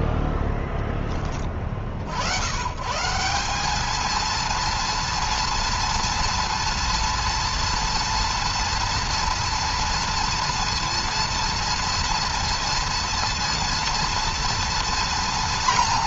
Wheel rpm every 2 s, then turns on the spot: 20, 110, 230, 230, 230, 230, 230, 230.
none